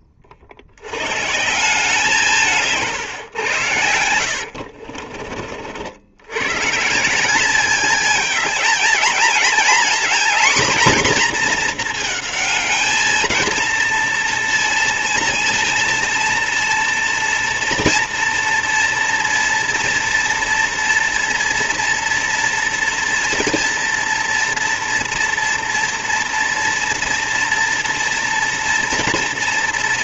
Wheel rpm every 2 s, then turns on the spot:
90, 160, 50, 140, 220, 240, 220, 230, 230, 230, 230, 230, 230, 230, 230.
4-6